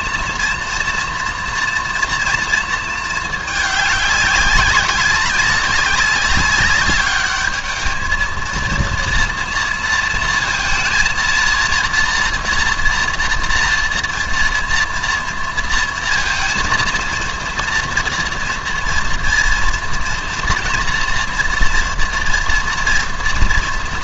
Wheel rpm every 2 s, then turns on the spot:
240, 230, 200, 200, 230, 230, 230, 230, 230, 230, 230, 230.
none